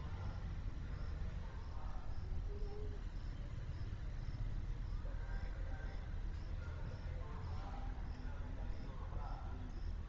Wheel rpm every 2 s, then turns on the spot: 0, 0, 0, 0, 0.
none